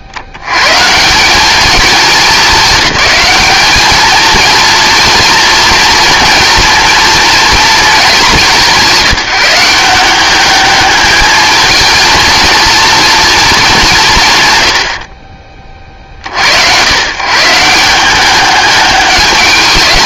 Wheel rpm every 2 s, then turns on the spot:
140, 210, 230, 230, 190, 210, 230, 100, 100, 210.
none